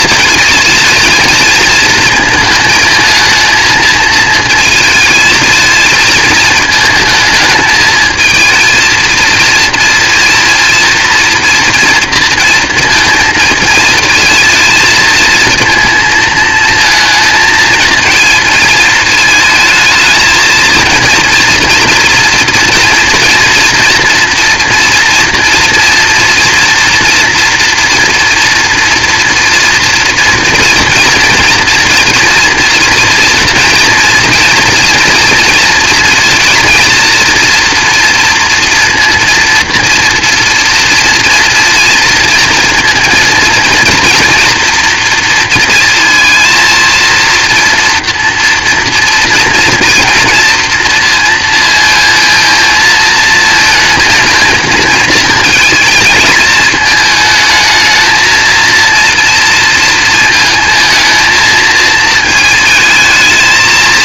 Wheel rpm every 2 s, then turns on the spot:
230, 220, 230, 220, 220, 230, 230, 230, 220, 220, 230, 230, 230, 230, 230, 230, 230, 230, 230, 230, 240, 230, 230, 230, 230, 230, 220, 220, 220, 230, 230, 220.
none